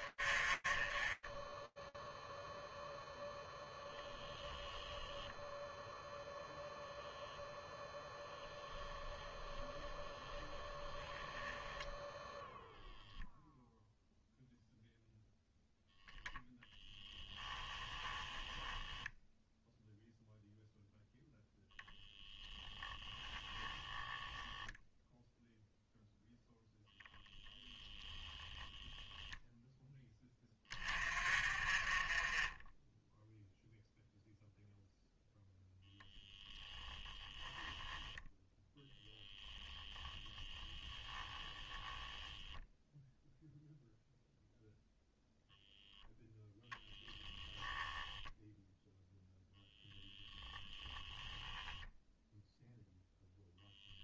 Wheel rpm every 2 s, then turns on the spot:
10, 0, 0, 10, 0, 0, 0, 10, 10, 0, 0, 0, 0, 0, 10, 30, 0, 0, 0, 10, 10, 0, 0, 0, 0, 0, 0.
38-40